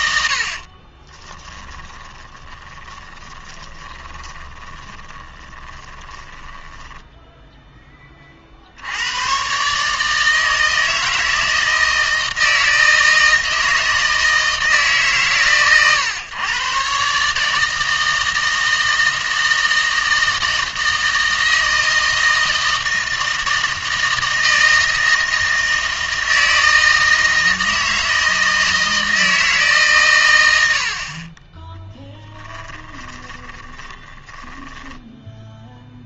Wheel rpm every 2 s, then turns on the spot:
40, 20, 20, 10, 70, 160, 160, 160, 130, 160, 160, 160, 160, 160, 160, 70, 10, 20.
0-8 32-36